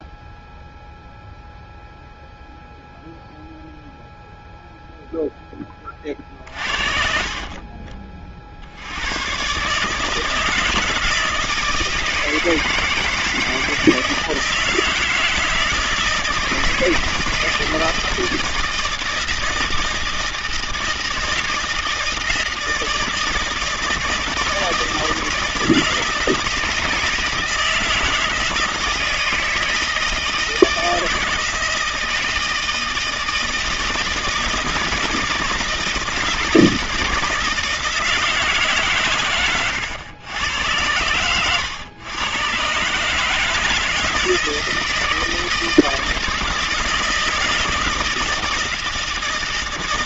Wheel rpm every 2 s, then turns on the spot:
0, 0, 0, 60, 110, 160, 160, 160, 160, 160, 160, 160, 160, 160, 160, 160, 160, 160, 160, 150, 100, 130, 160, 160, 160.
none